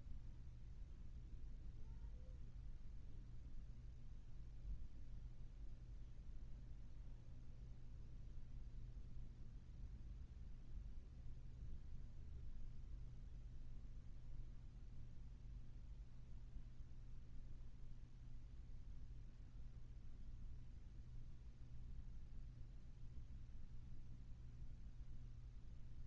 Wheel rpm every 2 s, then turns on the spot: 0, 0, 0, 0, 0, 0, 0, 0, 0, 0, 0, 0, 0.
none